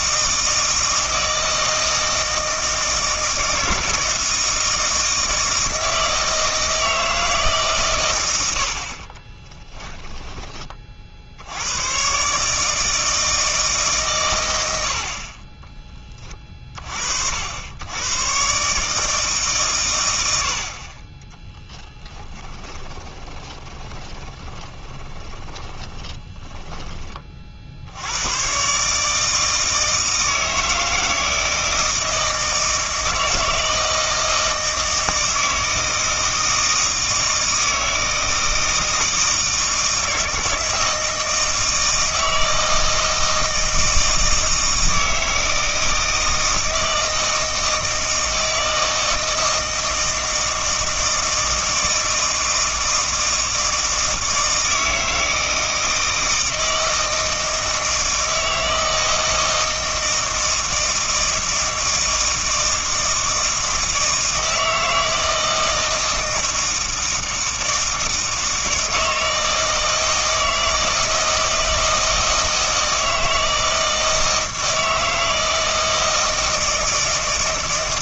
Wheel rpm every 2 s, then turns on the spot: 160, 160, 160, 160, 60, 40, 150, 80, 50, 150, 40, 20, 20, 30, 140, 160, 160, 160, 160, 160, 160, 160, 160, 160, 160, 160, 160, 160, 160, 160, 160, 160, 160, 160, 160, 160, 160, 160, 160.
22-28